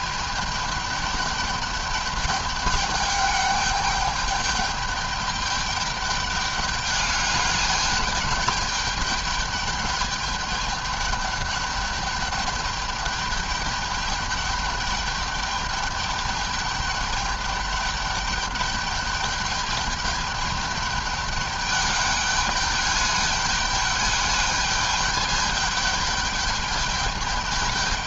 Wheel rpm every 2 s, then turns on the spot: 210, 210, 210, 200, 200, 210, 210, 210, 210, 210, 210, 200, 210, 210.
none